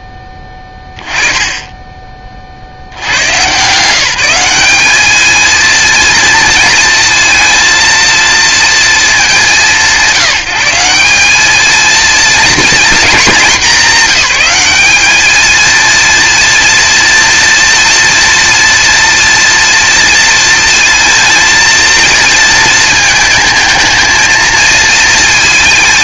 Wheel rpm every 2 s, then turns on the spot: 10, 40, 200, 230, 230, 170, 230, 200, 230, 230, 230, 220, 220.
none